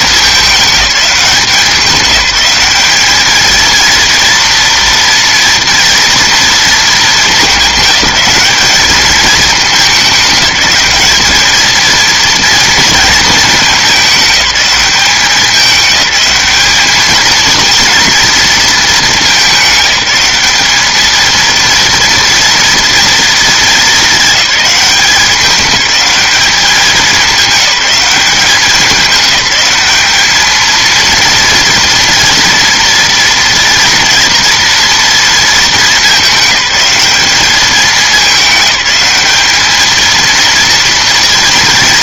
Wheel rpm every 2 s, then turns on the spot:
210, 190, 230, 230, 200, 210, 230, 200, 200, 230, 200, 230, 210, 200, 200, 220, 230, 240, 210, 190, 230.
none